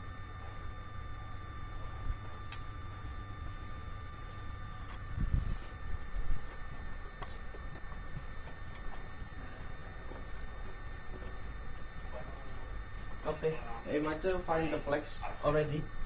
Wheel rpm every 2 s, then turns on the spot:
0, 0, 0, 0, 0, 0, 0, 0.
none